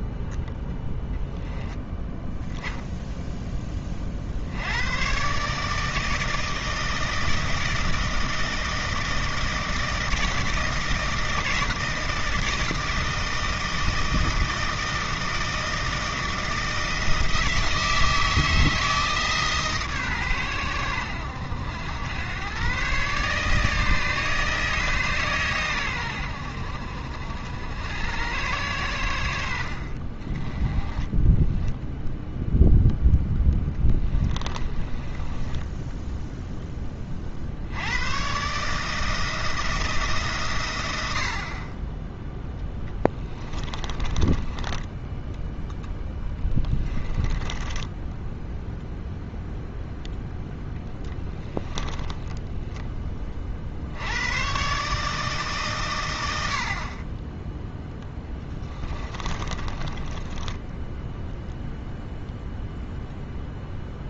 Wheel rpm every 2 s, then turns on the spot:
10, 0, 90, 160, 160, 160, 160, 160, 160, 160, 90, 130, 150, 60, 90, 20, 0, 20, 20, 150, 100, 10, 10, 20, 0, 10, 10, 140, 50, 20, 10, 0.
30-32 34-36 42-48 58-62